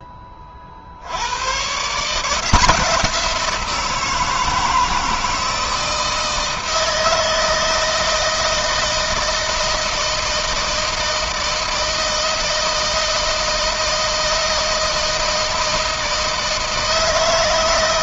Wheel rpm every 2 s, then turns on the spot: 40, 170, 160, 160, 160, 160, 160, 160, 160.
none